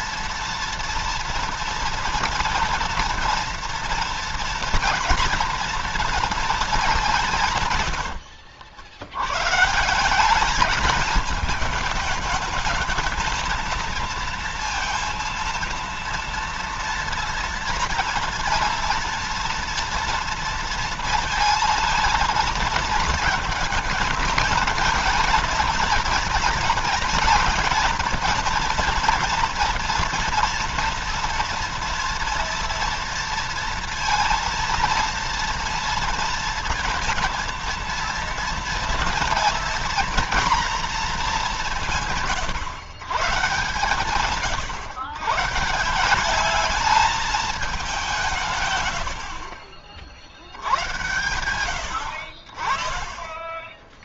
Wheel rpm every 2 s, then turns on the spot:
230, 230, 230, 220, 70, 210, 220, 230, 230, 230, 230, 230, 230, 230, 230, 240, 230, 230, 230, 230, 230, 130, 140, 210, 140, 80, 40.
none